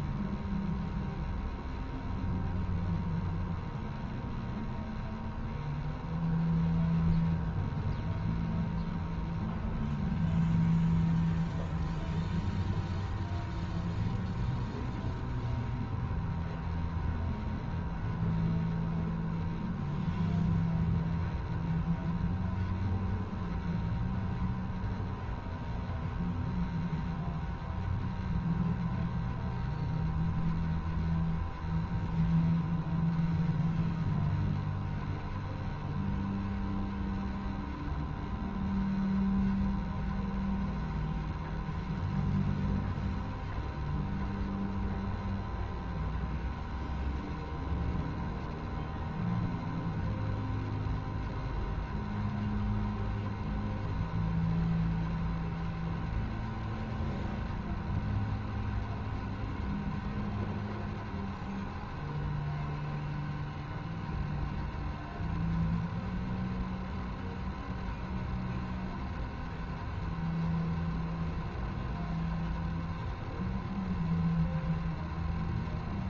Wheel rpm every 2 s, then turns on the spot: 0, 0, 0, 0, 0, 0, 0, 0, 0, 0, 0, 0, 0, 0, 0, 0, 0, 0, 0, 0, 0, 0, 0, 0, 0, 0, 0, 0, 0, 0, 0, 0, 0, 0, 0, 0, 0, 0.
none